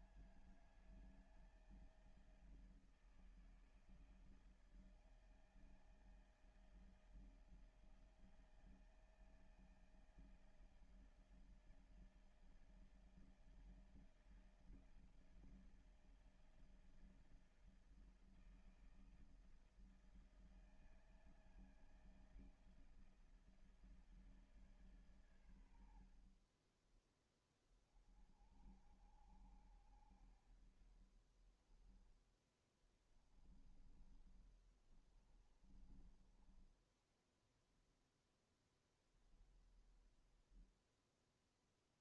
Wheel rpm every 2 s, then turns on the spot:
160, 160, 160, 160, 160, 160, 160, 160, 160, 160, 160, 160, 160, 70, 30, 60, 10, 30, 30, 0, 20.
26-28 32-38